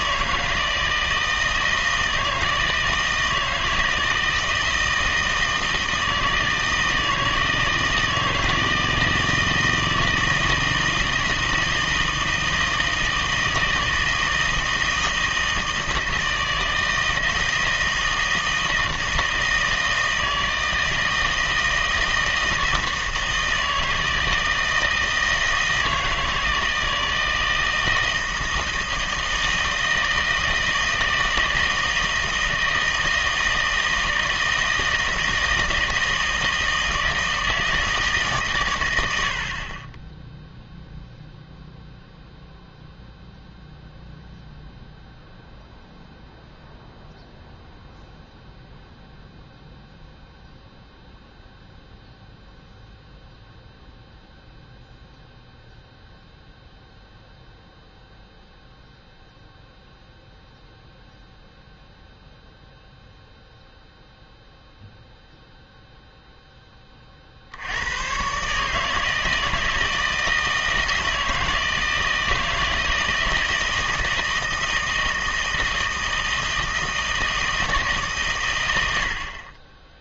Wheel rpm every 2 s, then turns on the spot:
160, 160, 160, 160, 160, 160, 160, 160, 160, 160, 160, 160, 160, 160, 160, 160, 160, 160, 160, 130, 0, 0, 0, 0, 0, 0, 0, 0, 0, 0, 0, 0, 0, 10, 140, 160, 160, 160, 160, 110.
none